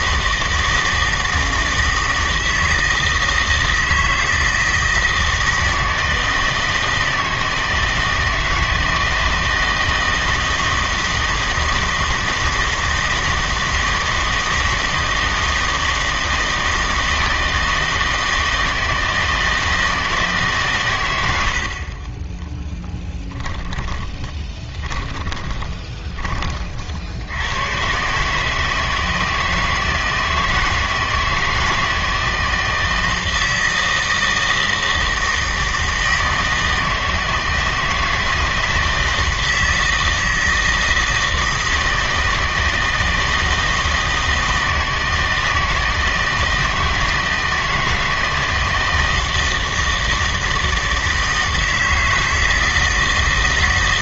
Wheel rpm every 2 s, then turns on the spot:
160, 160, 160, 160, 160, 160, 160, 160, 160, 160, 130, 10, 20, 50, 160, 160, 160, 160, 160, 160, 160, 160, 160, 160, 160, 160, 160.
24-26